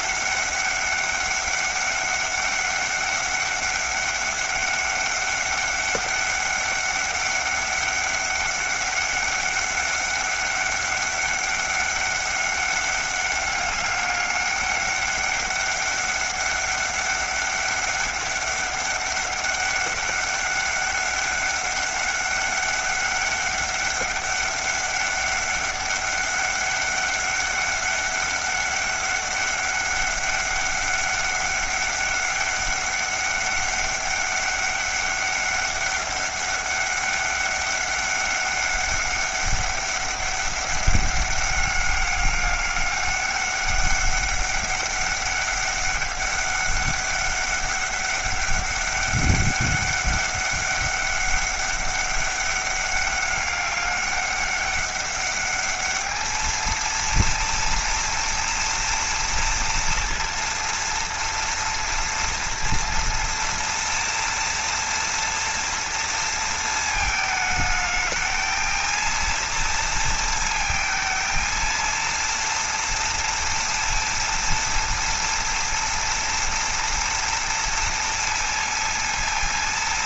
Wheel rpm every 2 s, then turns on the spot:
200, 200, 200, 200, 200, 200, 200, 200, 200, 200, 200, 200, 200, 200, 200, 200, 200, 200, 200, 200, 200, 200, 200, 200, 200, 200, 200, 200, 230, 230, 230, 230, 230, 220, 220, 230, 230, 230, 230, 230.
none